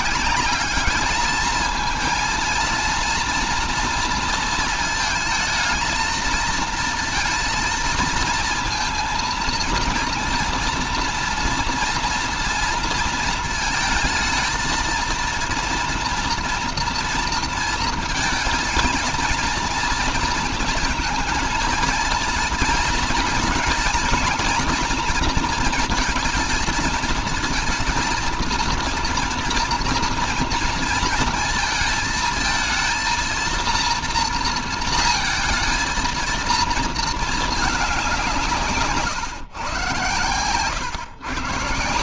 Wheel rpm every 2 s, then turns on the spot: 210, 230, 220, 230, 230, 240, 230, 230, 230, 240, 230, 230, 230, 230, 230, 230, 220, 230, 230, 160, 130.
none